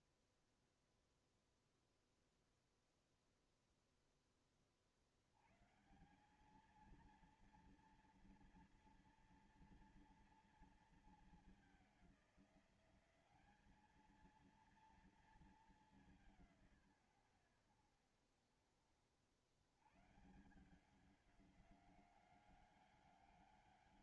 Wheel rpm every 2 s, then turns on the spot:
30, 0, 10, 180, 230, 230, 190, 220, 180, 60, 150, 190.
none